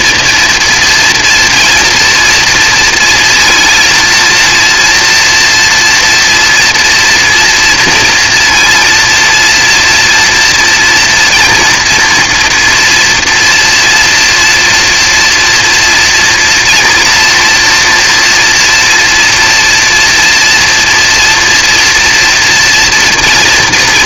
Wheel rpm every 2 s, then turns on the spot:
230, 230, 230, 240, 230, 240, 230, 230, 230, 230, 230, 230.
none